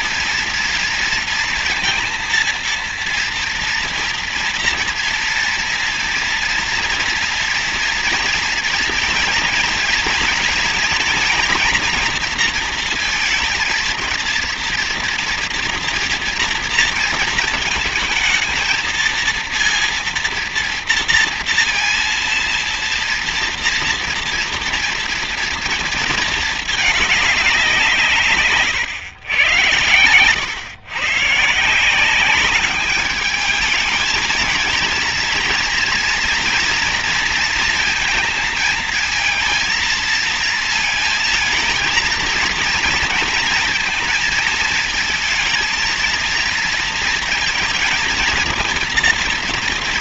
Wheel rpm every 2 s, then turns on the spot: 230, 230, 240, 230, 230, 230, 230, 230, 230, 230, 240, 230, 230, 210, 120, 130, 210, 230, 230, 230, 230, 230, 220, 230, 230.
none